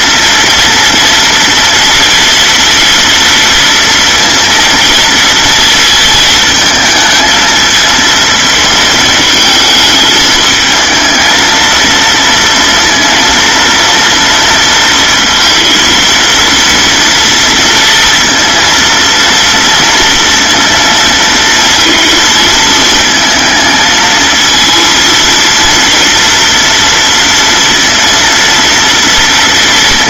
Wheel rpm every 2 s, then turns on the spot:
240, 230, 230, 220, 220, 220, 230, 230, 230, 230, 230, 220, 230, 230, 230.
none